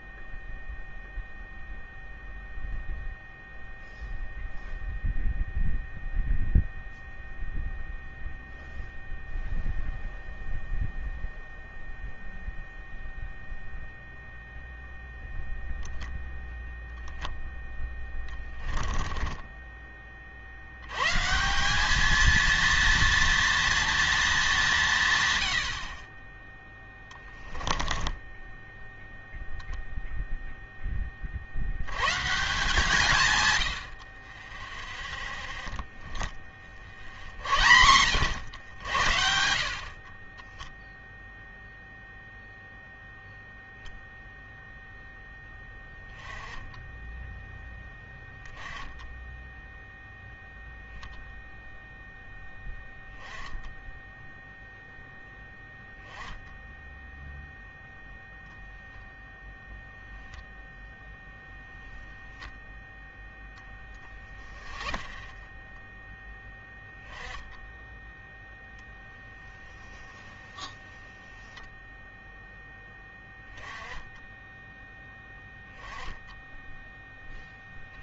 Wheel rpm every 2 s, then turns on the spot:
0, 0, 0, 0, 0, 0, 0, 0, 0, 10, 140, 240, 140, 10, 0, 10, 160, 0, 60, 80, 0, 0, 0, 10, 10, 0, 0, 0, 10, 0, 0, 10, 30, 10, 0, 10, 0, 10, 0.
18-20 26-28 64-66 70-72